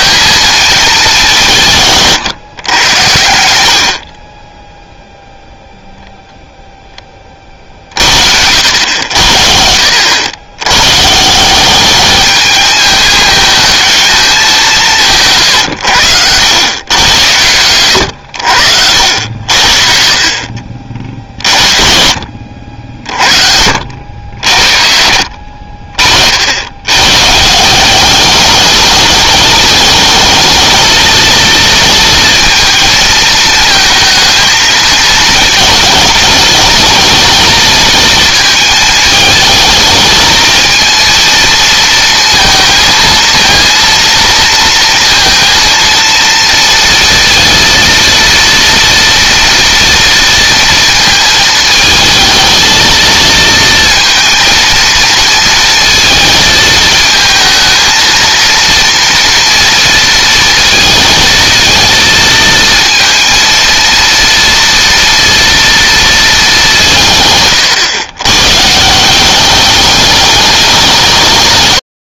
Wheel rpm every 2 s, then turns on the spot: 200, 90, 0, 20, 80, 130, 210, 170, 100, 80, 50, 50, 60, 110, 210, 230, 220, 220, 220, 220, 230, 230, 230, 230, 230, 220, 220, 230, 220, 230, 230, 230, 230, 160, 160, 180.
none